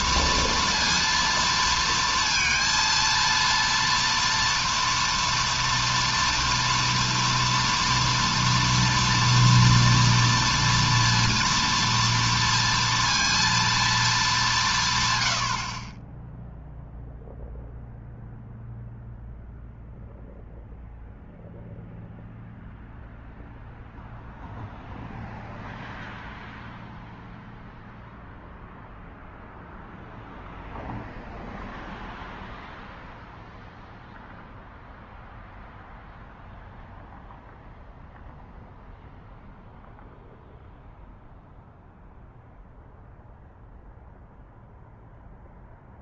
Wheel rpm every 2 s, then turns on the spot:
230, 230, 230, 230, 230, 230, 230, 190, 0, 0, 0, 0, 0, 0, 0, 0, 0, 0, 0, 0, 0, 0, 0.
none